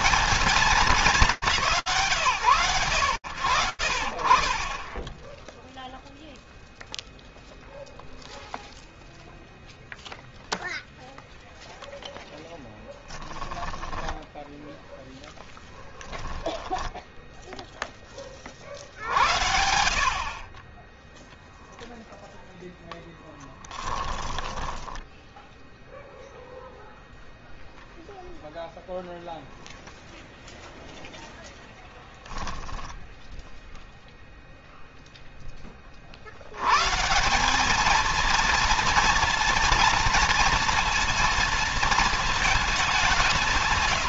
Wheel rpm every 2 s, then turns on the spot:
170, 50, 0, 0, 0, 0, 10, 10, 10, 60, 0, 10, 0, 0, 0, 0, 0, 10, 180, 230, 230, 180.
12-16